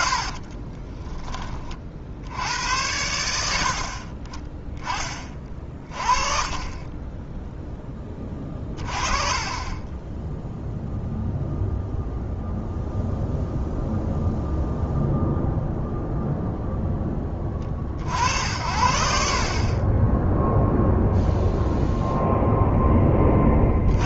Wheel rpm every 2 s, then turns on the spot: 30, 90, 10, 30, 30, 0, 0, 0, 0, 70, 0, 0.
0-2